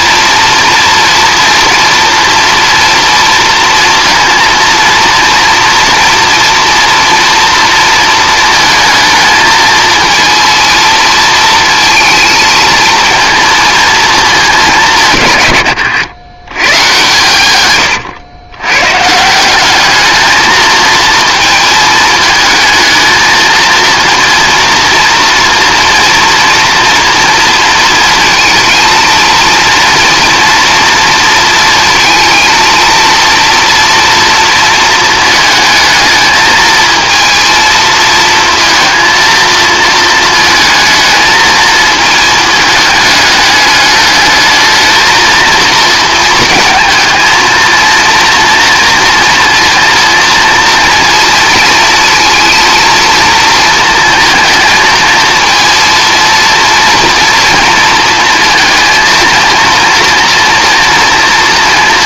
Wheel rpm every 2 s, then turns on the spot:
230, 230, 230, 230, 220, 230, 230, 180, 130, 110, 220, 220, 230, 230, 230, 230, 230, 230, 220, 230, 220, 210, 220, 230, 230, 230, 230, 230, 230, 230, 230.
none